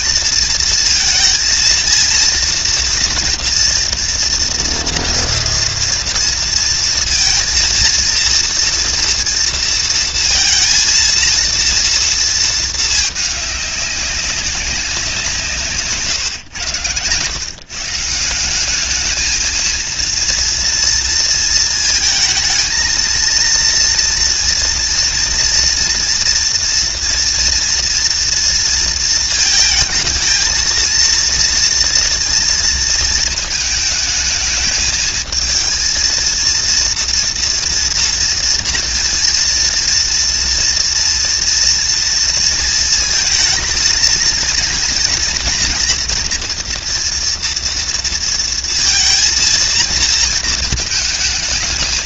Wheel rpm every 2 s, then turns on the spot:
230, 230, 230, 230, 230, 230, 210, 190, 110, 210, 230, 230, 230, 230, 220, 230, 230, 220, 230, 230, 230, 230, 230, 230, 230, 220.
none